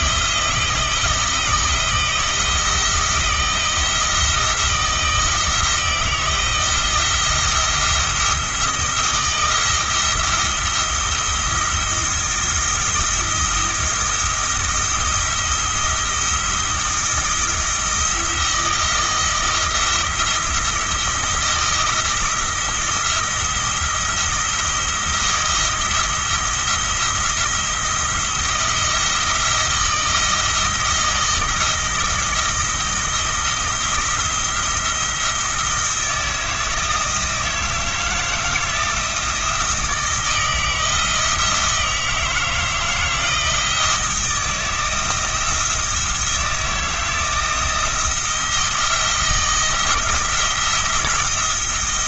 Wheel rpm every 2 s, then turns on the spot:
170, 160, 170, 160, 170, 170, 170, 170, 160, 160, 170, 170, 170, 170, 170, 170, 170, 170, 160, 160, 160, 160, 170, 160, 170, 170.
none